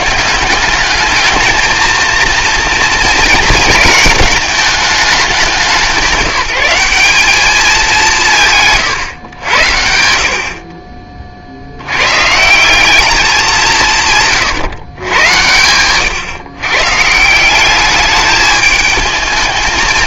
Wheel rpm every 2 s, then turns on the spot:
200, 230, 210, 190, 140, 40, 190, 120, 140, 210.
none